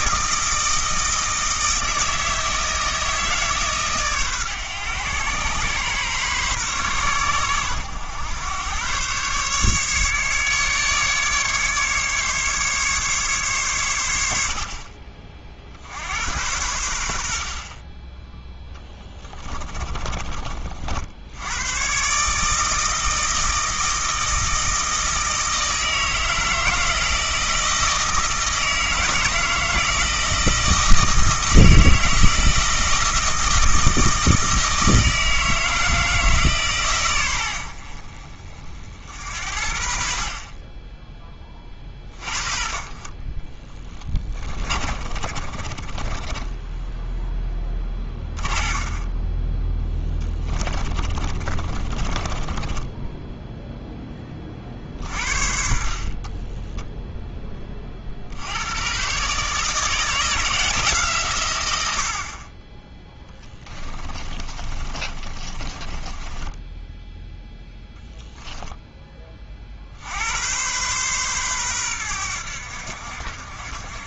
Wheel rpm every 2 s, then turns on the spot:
160, 160, 120, 120, 120, 150, 150, 50, 90, 10, 60, 160, 160, 160, 160, 160, 160, 160, 130, 50, 30, 40, 30, 10, 20, 20, 20, 50, 10, 120, 160, 20, 30, 10, 10, 120, 70.
18-20 44-54 64-68